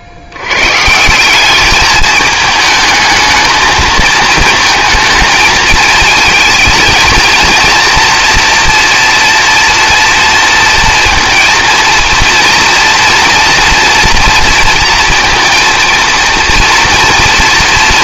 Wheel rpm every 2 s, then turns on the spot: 70, 220, 230, 220, 230, 230, 230, 230, 230.
none